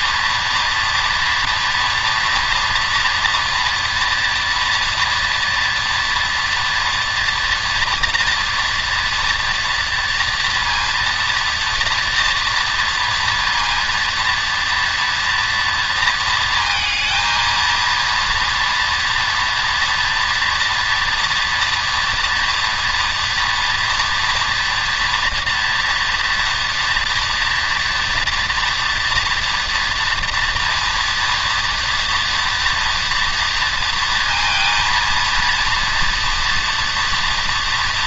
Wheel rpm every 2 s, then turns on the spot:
230, 230, 230, 230, 230, 230, 230, 230, 230, 230, 240, 230, 240, 230, 230, 230, 230, 230, 230.
none